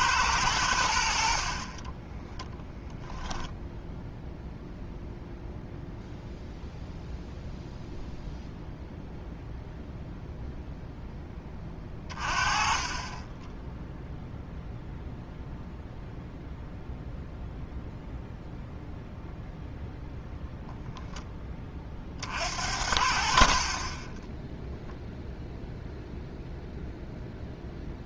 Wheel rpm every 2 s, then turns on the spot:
80, 10, 0, 0, 0, 0, 40, 0, 0, 0, 0, 60, 0, 0.
12-14